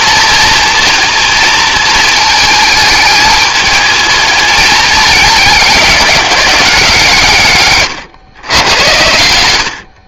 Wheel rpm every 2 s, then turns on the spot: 230, 210, 210, 160, 110.
none